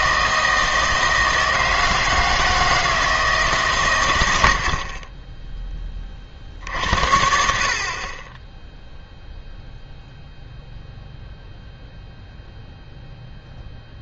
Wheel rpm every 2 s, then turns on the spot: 160, 160, 100, 30, 40, 0, 0.
none